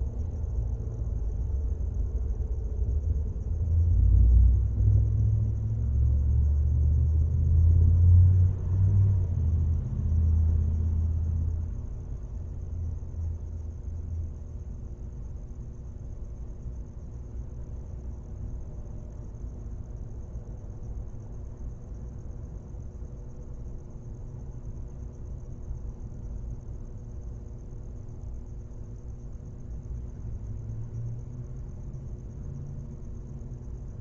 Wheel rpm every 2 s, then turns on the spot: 0, 0, 0, 0, 0, 0, 0, 0, 0, 0, 0, 0, 0, 0, 0, 0, 0.
none